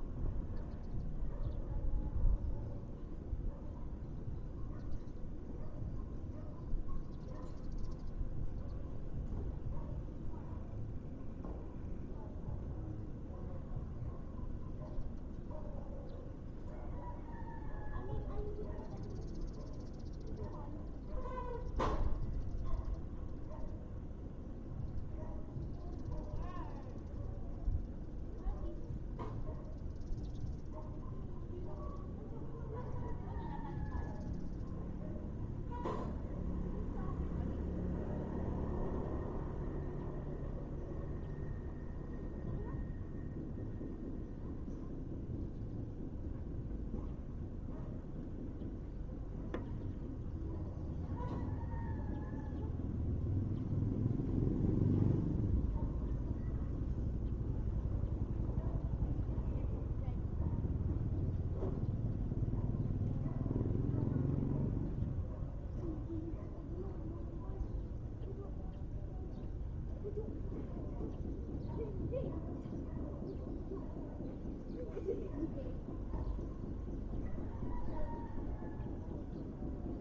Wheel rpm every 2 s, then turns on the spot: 0, 0, 0, 0, 0, 0, 0, 0, 0, 0, 0, 0, 0, 0, 0, 0, 0, 0, 0, 0, 0, 0, 0, 0, 0, 0, 0, 0, 0, 0, 0, 0, 0, 0, 0, 0, 0, 0, 0, 0.
none